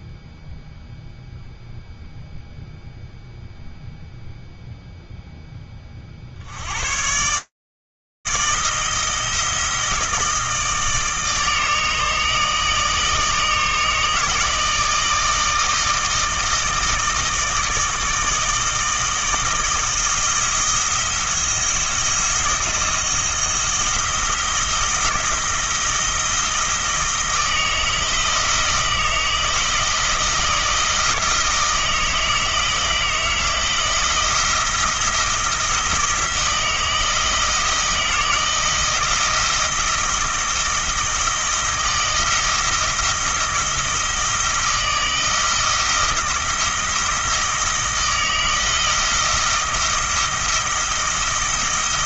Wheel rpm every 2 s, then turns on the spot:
0, 0, 0, 100, 160, 150, 160, 160, 160, 160, 170, 160, 160, 160, 160, 160, 160, 170, 160, 160, 160, 160, 160, 160, 160, 160.
none